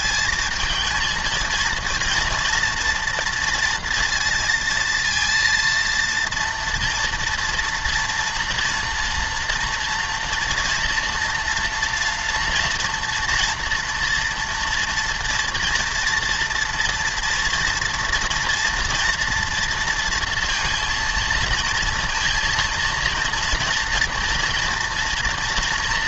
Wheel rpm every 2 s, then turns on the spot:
220, 230, 230, 230, 230, 230, 230, 230, 230, 240, 230, 230, 230.
none